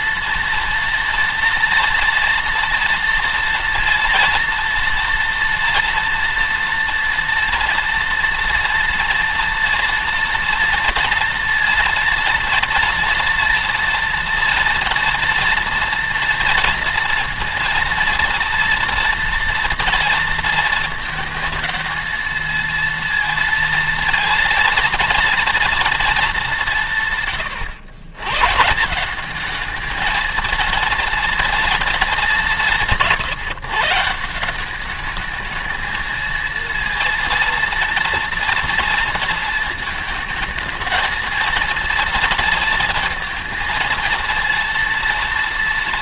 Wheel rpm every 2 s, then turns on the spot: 230, 230, 230, 230, 230, 230, 230, 230, 230, 230, 230, 230, 230, 180, 140, 230, 190, 180, 220, 230, 220, 230, 230.
none